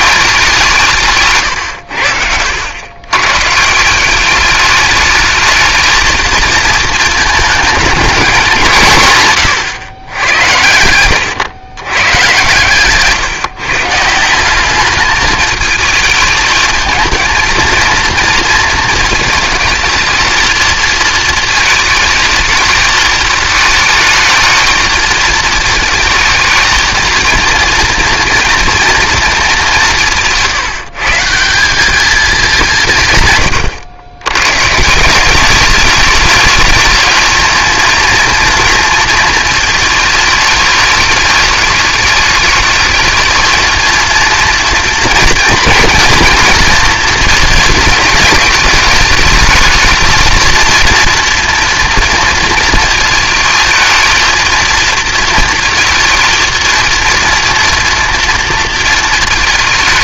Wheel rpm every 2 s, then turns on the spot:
170, 100, 210, 220, 160, 90, 140, 200, 220, 220, 230, 220, 220, 230, 230, 150, 180, 150, 210, 230, 210, 210, 230, 230, 210, 230, 220, 230, 230, 220.
12-14